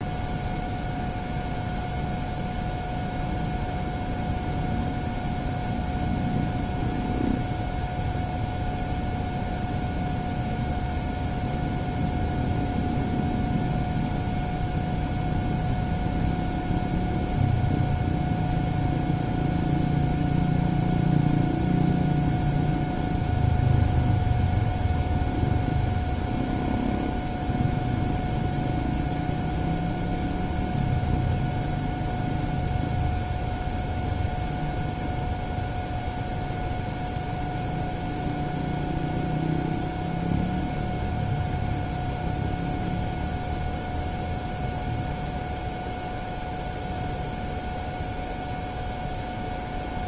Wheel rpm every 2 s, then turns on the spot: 0, 0, 0, 0, 0, 0, 0, 0, 0, 0, 0, 0, 0, 0, 0, 0, 0, 0, 0, 0, 0, 0, 0, 0, 0.
none